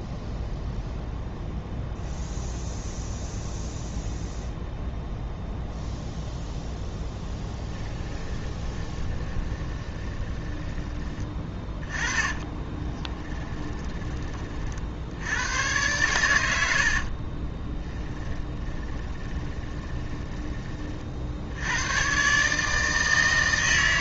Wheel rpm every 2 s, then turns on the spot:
0, 0, 0, 0, 20, 20, 20, 40, 90, 20, 20, 140.
8-10 12-14 18-20